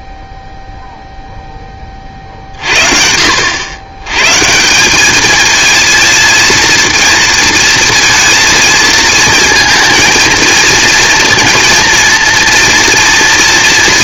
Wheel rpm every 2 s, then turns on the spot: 0, 50, 160, 230, 230, 230, 230.
none